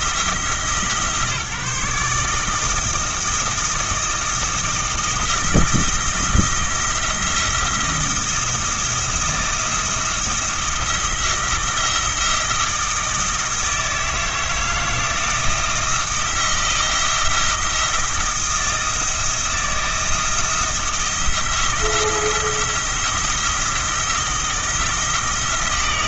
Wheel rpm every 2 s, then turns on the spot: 160, 160, 170, 170, 170, 170, 160, 160, 170, 160, 160, 170, 170.
none